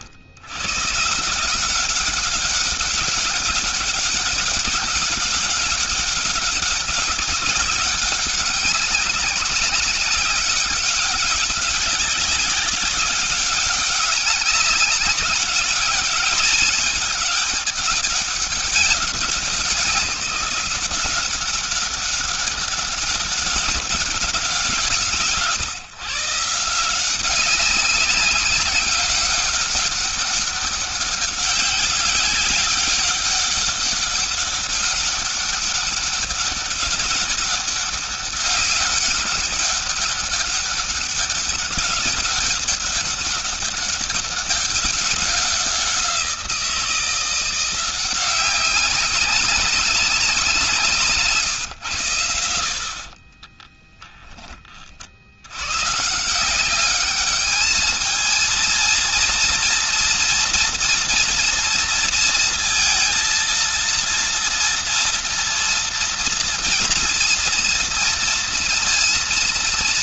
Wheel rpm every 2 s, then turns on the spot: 100, 190, 200, 200, 200, 190, 190, 200, 210, 200, 180, 190, 180, 160, 200, 200, 190, 200, 200, 200, 200, 200, 200, 180, 190, 190, 80, 20, 170, 230, 230, 230, 230, 240, 230.
none